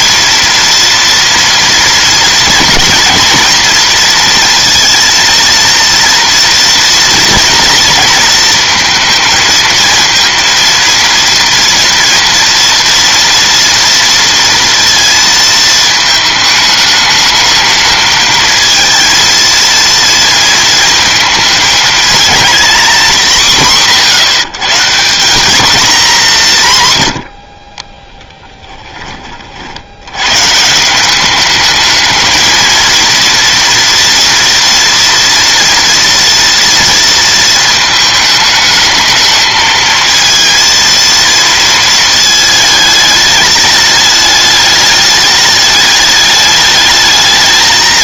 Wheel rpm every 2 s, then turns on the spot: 230, 240, 230, 230, 230, 230, 230, 230, 220, 220, 230, 210, 140, 170, 20, 160, 230, 230, 230, 220, 230, 220, 210, 210.
none